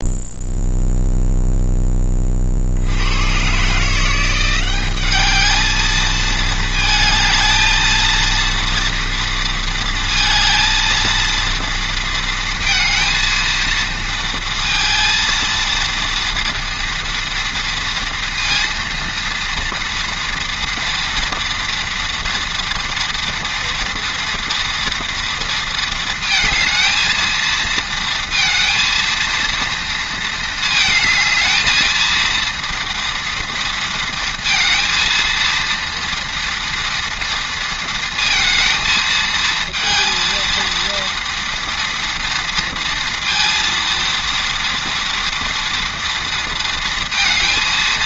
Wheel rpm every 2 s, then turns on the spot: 0, 60, 190, 220, 230, 230, 230, 230, 230, 230, 230, 230, 230, 220, 230, 220, 230, 230, 230, 230, 230, 230, 230, 230.
none